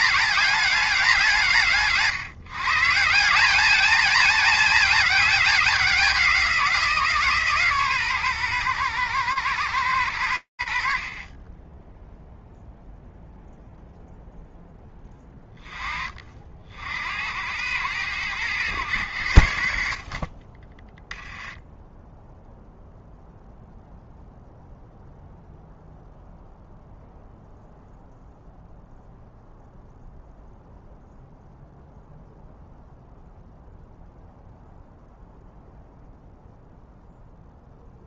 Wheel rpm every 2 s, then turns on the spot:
200, 150, 220, 170, 120, 40, 0, 10, 70, 90, 10, 0, 0, 0, 0, 0, 0, 0, 0.
20-22